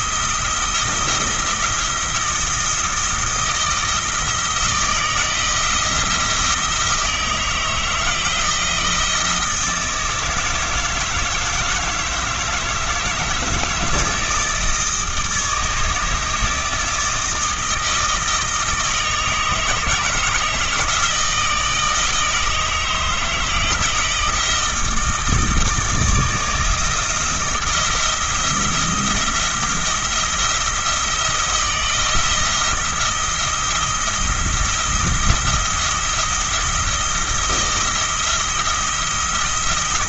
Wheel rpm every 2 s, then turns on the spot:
170, 160, 160, 160, 170, 160, 150, 160, 160, 160, 160, 160, 160, 160, 170, 170, 170, 170, 170, 170.
none